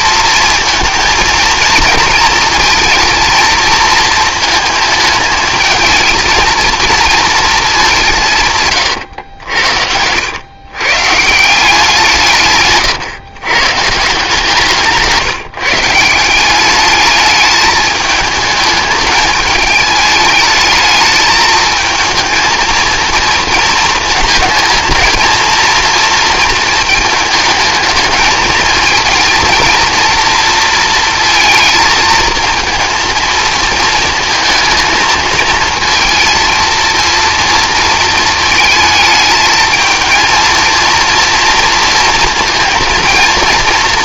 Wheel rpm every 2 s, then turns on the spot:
230, 230, 220, 230, 110, 120, 140, 160, 210, 220, 220, 230, 230, 220, 220, 230, 230, 220, 240, 220, 230, 230.
8-10